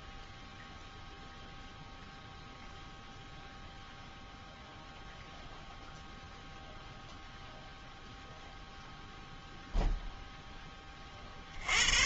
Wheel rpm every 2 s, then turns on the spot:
0, 0, 0, 0, 0, 20.
none